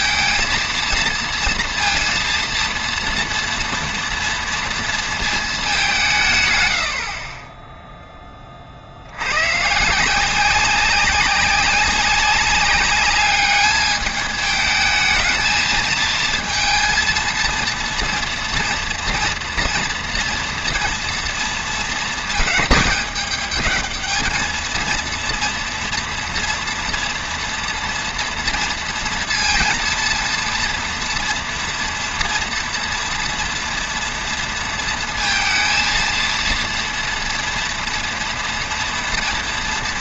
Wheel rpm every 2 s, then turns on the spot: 230, 230, 220, 50, 90, 190, 210, 220, 230, 230, 230, 210, 230, 230, 230, 230, 230, 220, 240, 240.
none